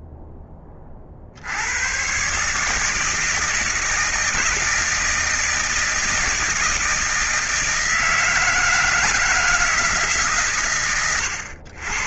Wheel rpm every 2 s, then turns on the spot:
10, 130, 160, 160, 160, 120.
none